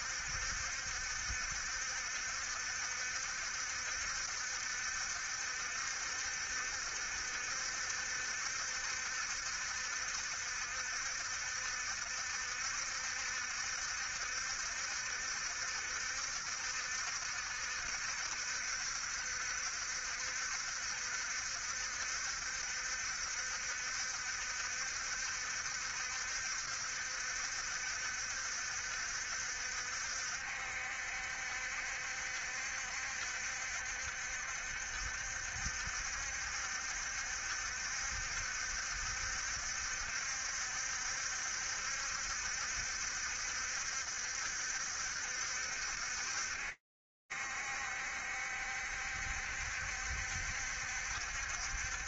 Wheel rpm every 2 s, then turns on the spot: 70, 70, 70, 70, 70, 70, 70, 70, 70, 70, 70, 70, 70, 70, 60, 70, 60, 70, 70, 60, 70, 70, 70, 70, 70, 70.
none